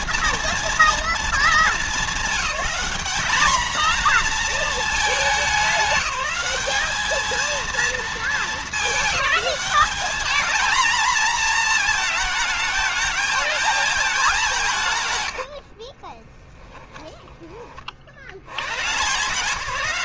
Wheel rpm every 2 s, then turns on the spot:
230, 220, 220, 210, 200, 230, 210, 160, 10, 130.
16-18